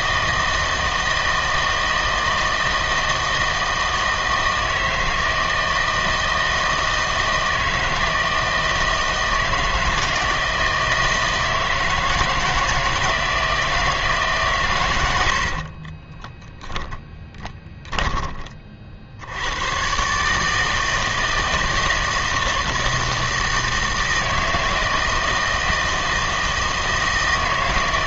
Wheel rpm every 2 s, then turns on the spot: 160, 160, 160, 160, 160, 160, 160, 130, 10, 40, 160, 160, 160, 160.
16-18